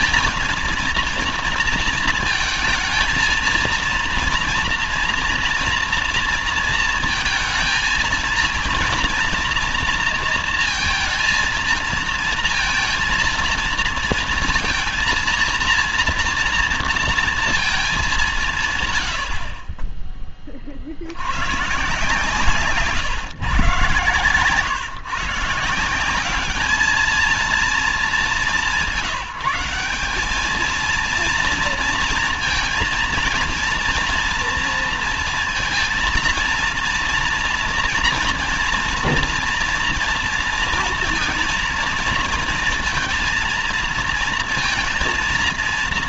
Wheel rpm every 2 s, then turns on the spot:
230, 230, 230, 230, 230, 230, 230, 230, 230, 170, 30, 140, 130, 200, 210, 210, 230, 230, 230, 240, 230, 230, 230.
none